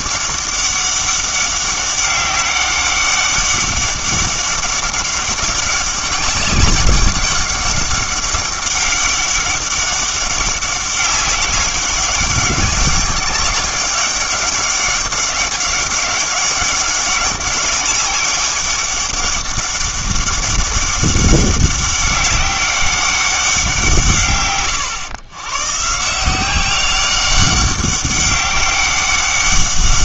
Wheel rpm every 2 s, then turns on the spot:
200, 200, 200, 200, 200, 190, 190, 200, 200, 200, 200, 200, 100, 190, 200.
none